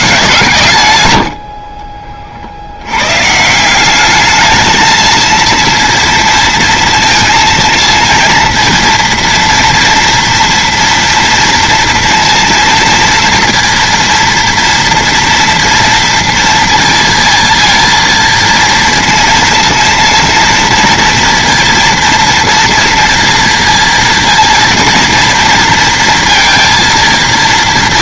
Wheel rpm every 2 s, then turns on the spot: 140, 70, 220, 230, 230, 230, 230, 230, 230, 230, 230, 230, 230, 230.
none